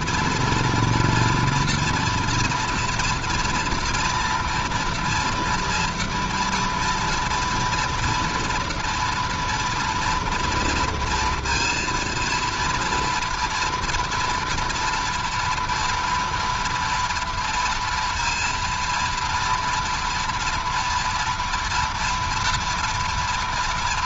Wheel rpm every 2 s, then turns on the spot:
230, 240, 230, 230, 230, 230, 230, 230, 230, 230, 240, 230.
none